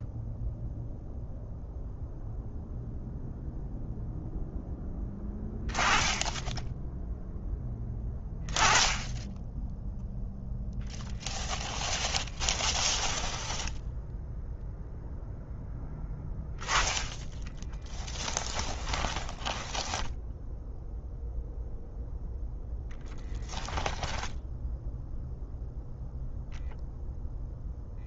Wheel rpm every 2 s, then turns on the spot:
0, 0, 10, 10, 20, 0, 10, 0, 10, 20, 0, 0, 0, 0.
12-14 18-20